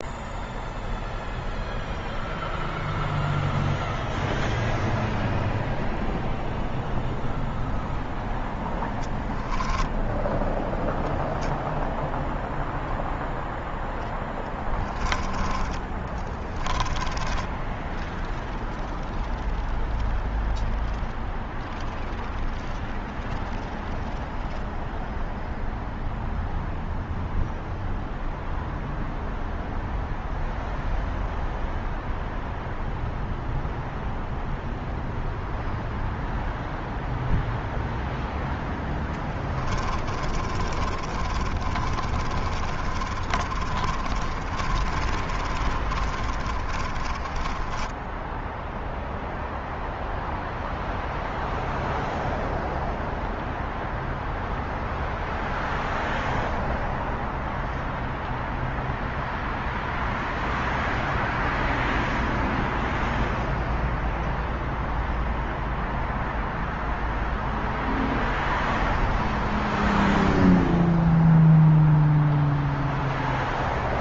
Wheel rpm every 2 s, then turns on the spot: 0, 0, 0, 0, 10, 0, 0, 20, 20, 0, 0, 0, 0, 0, 0, 0, 0, 0, 0, 10, 30, 30, 30, 20, 0, 0, 0, 0, 0, 0, 0, 0, 0, 0, 0, 0, 0.
8-10 16-18 38-48